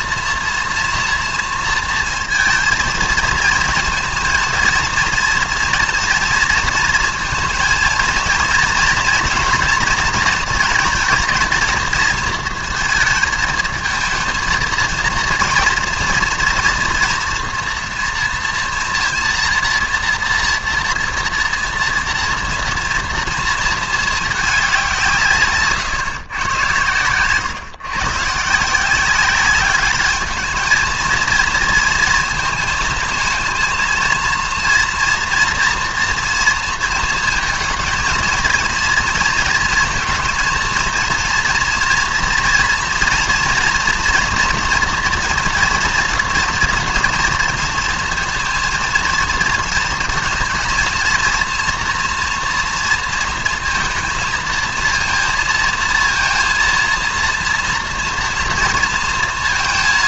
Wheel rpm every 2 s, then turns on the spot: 230, 230, 230, 230, 240, 230, 230, 230, 230, 230, 230, 230, 190, 120, 160, 220, 220, 230, 230, 230, 230, 230, 230, 230, 220, 220, 230, 230, 230, 230.
none